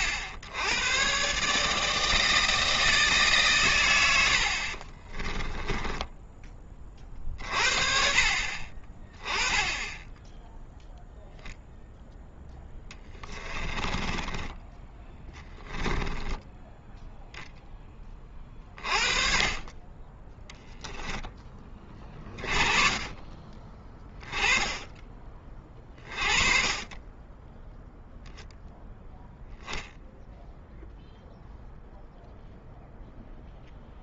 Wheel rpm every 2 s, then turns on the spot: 100, 160, 50, 20, 30, 0, 10, 10, 10, 30, 0, 30, 10, 30, 0, 0, 0.
4-6 12-14 16-18